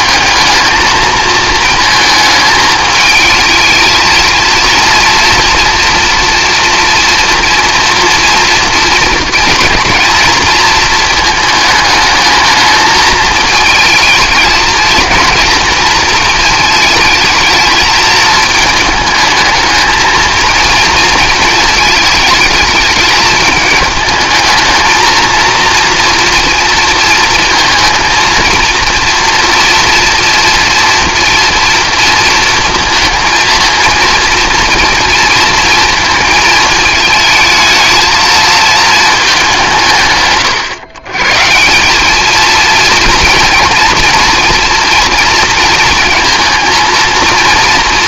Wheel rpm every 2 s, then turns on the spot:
220, 220, 230, 240, 230, 220, 220, 230, 220, 220, 230, 210, 220, 230, 240, 240, 230, 230, 220, 220, 130, 230, 240, 230.
none